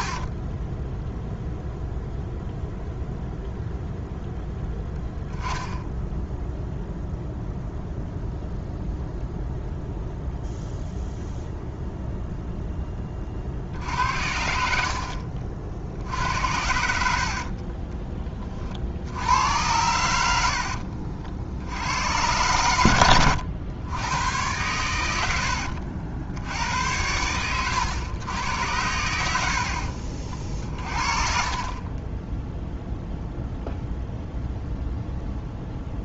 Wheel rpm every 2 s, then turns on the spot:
10, 0, 10, 0, 0, 0, 20, 50, 60, 60, 70, 110, 100, 100, 90, 50, 0, 0.
0-2 20-22